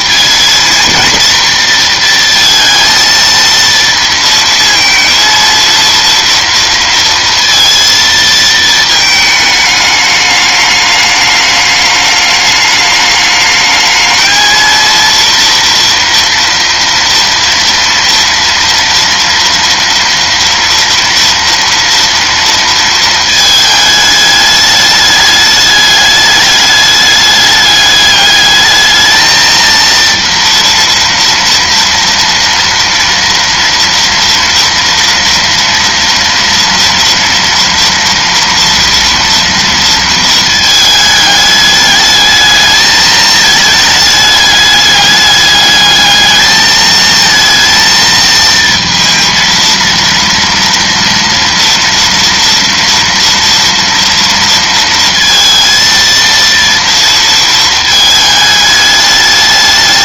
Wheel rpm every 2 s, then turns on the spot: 230, 230, 230, 230, 220, 210, 210, 230, 230, 230, 230, 230, 210, 210, 210, 240, 230, 230, 240, 240, 220, 220, 210, 220, 230, 230, 230, 230, 230, 210.
none